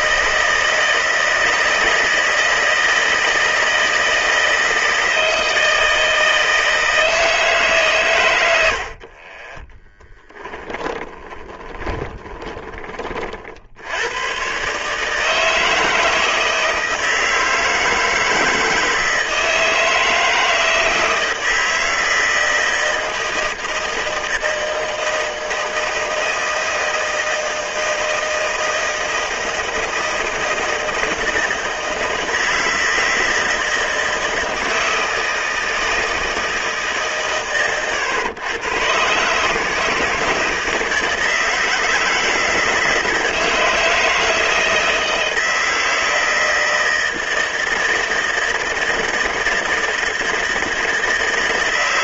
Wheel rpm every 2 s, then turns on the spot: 160, 160, 160, 160, 90, 10, 20, 110, 160, 160, 160, 160, 160, 160, 160, 160, 160, 160, 160, 120, 160, 160, 160, 160, 160, 160.
10-14